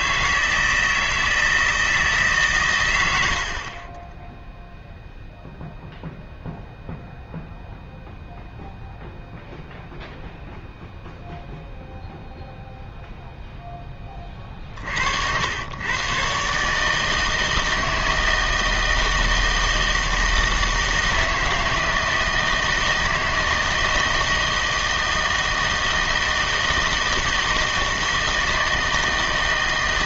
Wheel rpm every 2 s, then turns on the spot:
160, 130, 0, 0, 0, 0, 0, 50, 140, 160, 160, 160, 160, 160, 160.
none